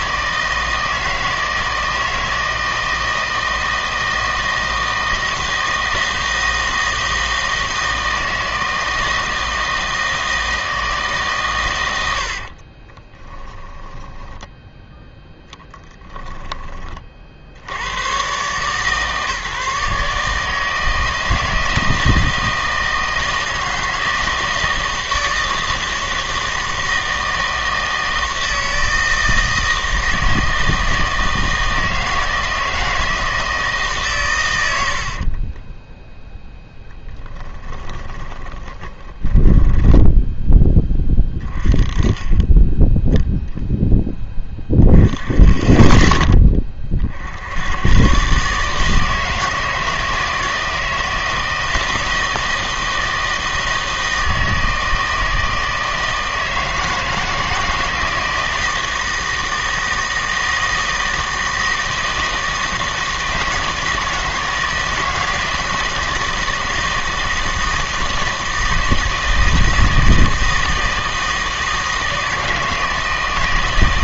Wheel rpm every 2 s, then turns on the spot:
160, 160, 160, 160, 160, 160, 40, 10, 20, 140, 160, 160, 160, 160, 160, 160, 160, 100, 10, 20, 10, 10, 20, 20, 150, 160, 160, 160, 160, 160, 160, 160, 160, 160, 160, 160, 160.
12-16 36-40